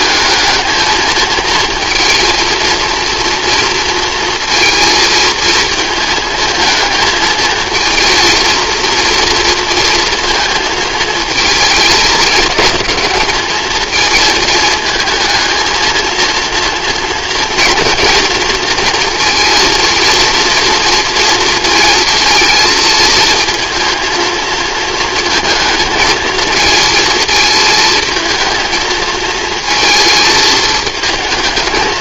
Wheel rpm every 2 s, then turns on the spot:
220, 230, 230, 220, 230, 230, 220, 220, 230, 230, 230, 230, 230, 220, 220, 220.
none